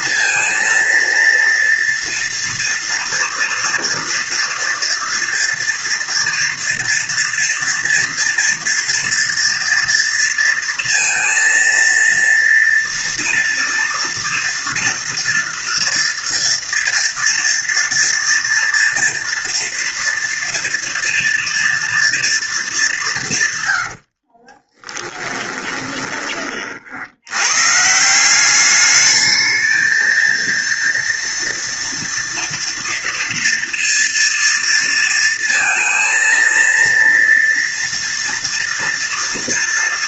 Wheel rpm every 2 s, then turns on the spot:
230, 230, 230, 230, 240, 230, 230, 230, 230, 240, 230, 220, 30, 30, 190, 230, 230, 230, 230, 230.
24-26